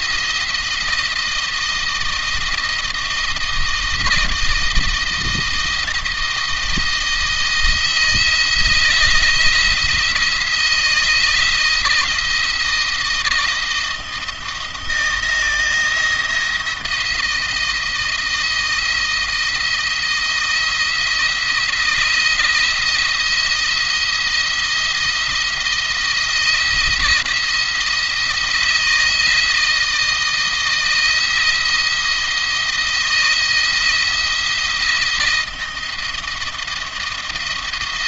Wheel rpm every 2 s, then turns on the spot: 170, 170, 170, 160, 170, 170, 160, 170, 170, 170, 170, 170, 170, 170, 160, 170, 170, 170, 170.
none